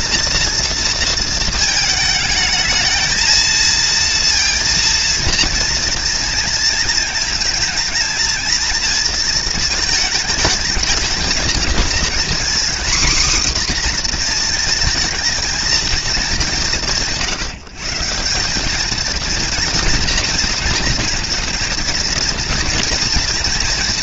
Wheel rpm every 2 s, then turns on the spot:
230, 220, 230, 230, 230, 220, 230, 250, 200, 160, 230, 230.
none